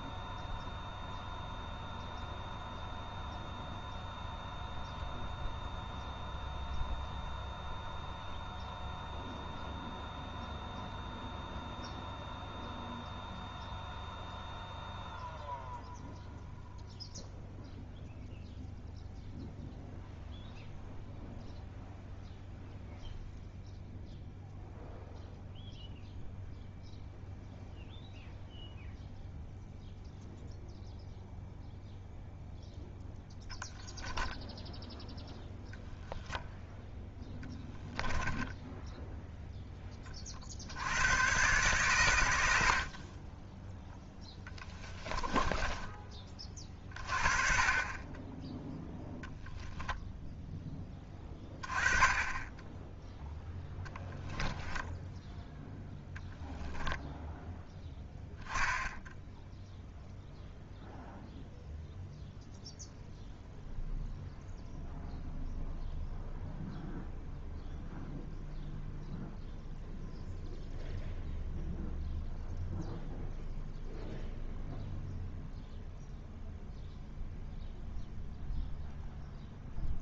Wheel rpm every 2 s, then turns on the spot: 0, 0, 0, 0, 0, 0, 0, 0, 0, 0, 0, 0, 0, 0, 0, 0, 0, 0, 0, 0, 80, 70, 10, 30, 0, 10, 10, 10, 10, 0, 0, 0, 0, 0, 0, 0, 0, 0, 0, 0.
44-46 54-56